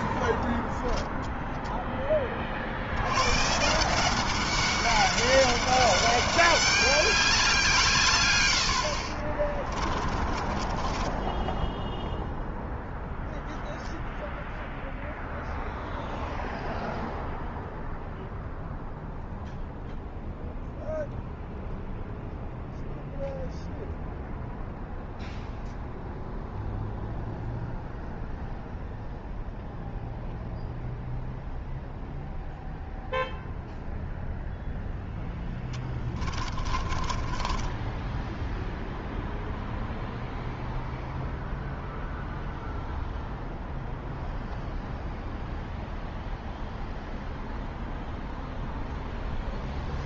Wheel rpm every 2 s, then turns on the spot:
0, 120, 200, 190, 40, 10, 0, 0, 0, 0, 0, 0, 0, 0, 0, 0, 0, 0, 20, 0, 0, 0, 0, 0, 0.
8-12 36-38